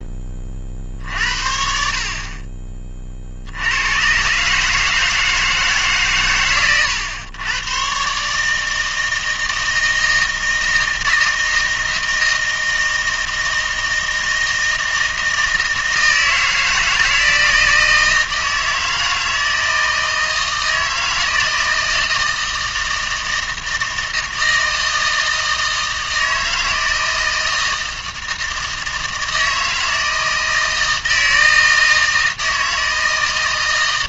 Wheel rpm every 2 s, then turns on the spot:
50, 30, 150, 110, 160, 160, 160, 160, 160, 160, 160, 160, 160, 160, 160, 160, 160.
none